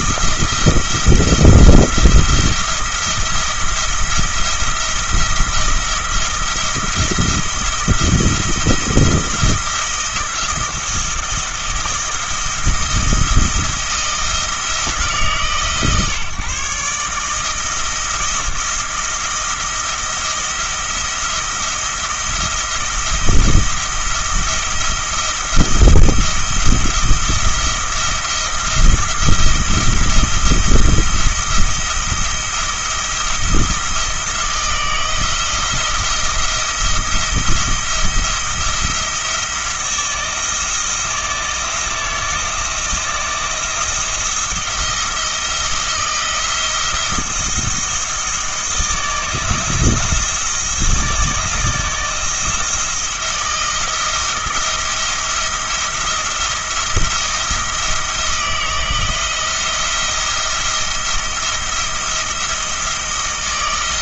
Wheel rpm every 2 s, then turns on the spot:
170, 170, 170, 170, 170, 170, 170, 160, 150, 170, 170, 170, 170, 170, 170, 170, 170, 160, 170, 170, 170, 160, 170, 170, 160, 160, 160, 170, 160, 160, 170, 160.
none